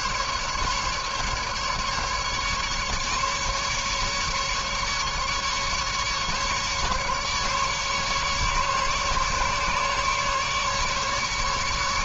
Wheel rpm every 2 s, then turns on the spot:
150, 150, 140, 140, 140, 150.
none